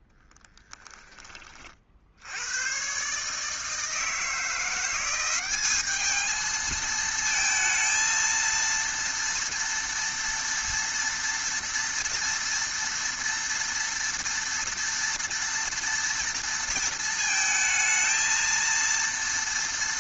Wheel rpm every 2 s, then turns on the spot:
10, 90, 170, 220, 230, 230, 230, 230, 230, 230.
0-2